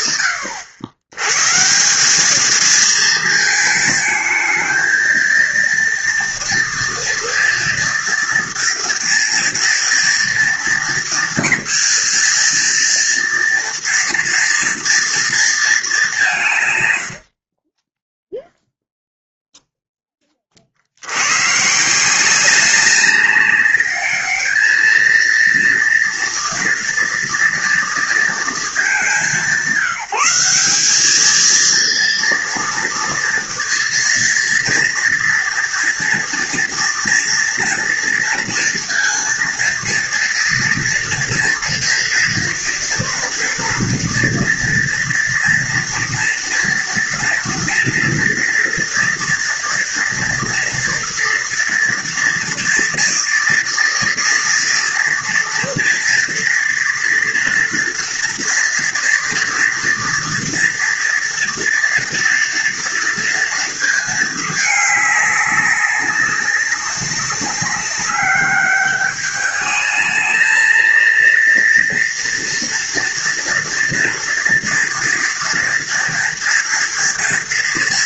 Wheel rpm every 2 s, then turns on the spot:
110, 220, 230, 230, 230, 230, 230, 230, 80, 0, 90, 200, 230, 230, 200, 220, 230, 230, 230, 230, 230, 230, 230, 230, 230, 240, 230, 230, 240, 230, 230, 230, 200, 190, 210, 230, 230, 230, 230.
16-18